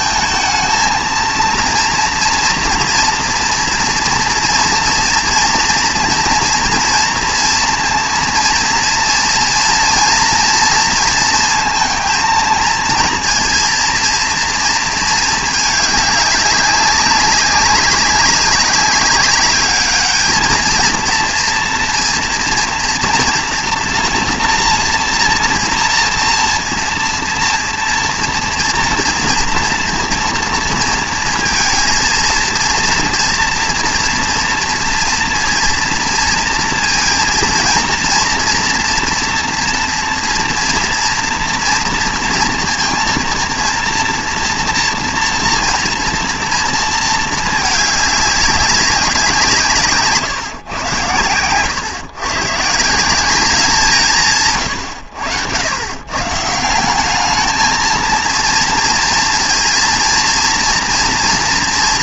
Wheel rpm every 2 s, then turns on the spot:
220, 230, 230, 230, 230, 230, 220, 230, 200, 190, 220, 240, 230, 230, 230, 230, 230, 230, 230, 230, 230, 230, 230, 230, 200, 120, 140, 140, 160, 230, 230.
none